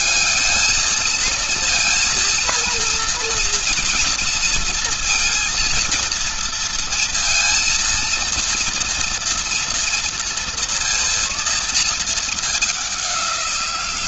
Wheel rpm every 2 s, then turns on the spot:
220, 230, 230, 230, 230, 230, 200.
none